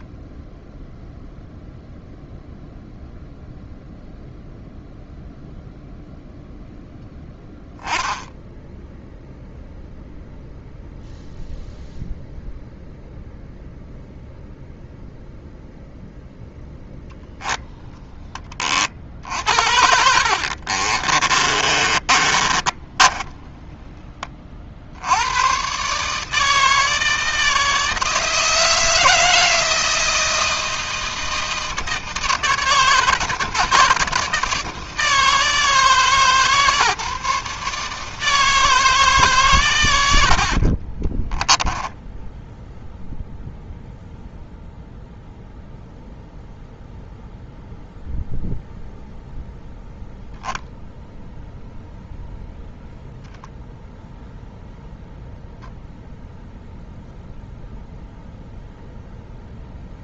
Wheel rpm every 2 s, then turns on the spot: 0, 0, 0, 10, 0, 0, 0, 0, 10, 50, 40, 20, 60, 160, 160, 160, 160, 160, 150, 160, 30, 0, 0, 0, 0, 0, 10, 0, 0, 0.
20-24 40-42